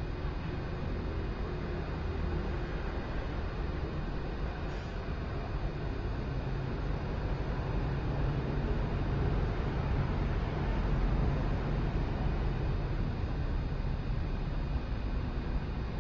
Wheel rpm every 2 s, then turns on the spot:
0, 0, 0, 0, 0, 0, 0, 0.
none